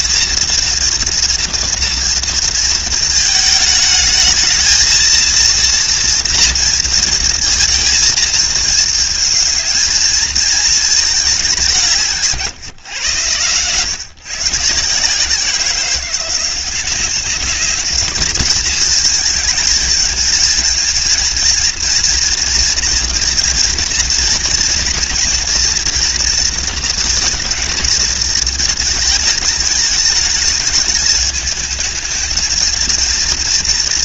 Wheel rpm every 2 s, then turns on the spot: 230, 220, 230, 230, 220, 210, 120, 160, 200, 220, 230, 240, 240, 230, 220, 220, 230.
none